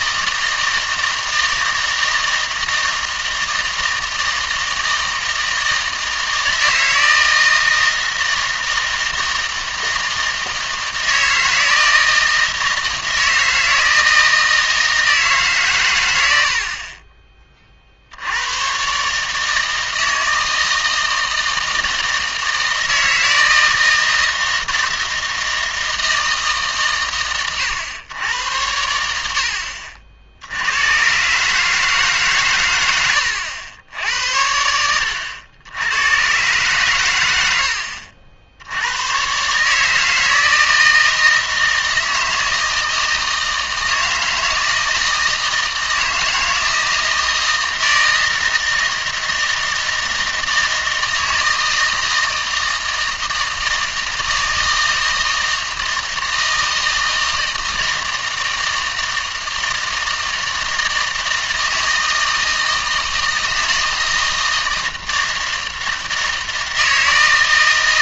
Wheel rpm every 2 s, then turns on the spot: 160, 160, 160, 160, 160, 160, 160, 160, 60, 110, 160, 160, 160, 150, 90, 80, 120, 80, 120, 90, 160, 160, 160, 160, 160, 160, 160, 160, 160, 160, 160, 160, 160, 160.
none